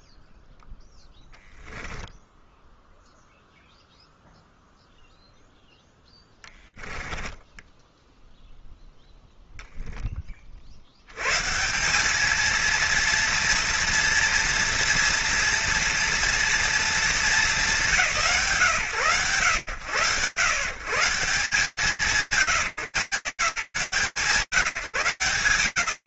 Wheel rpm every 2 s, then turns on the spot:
0, 0, 0, 10, 0, 110, 230, 230, 200, 100, 150, 180, 170.
6-8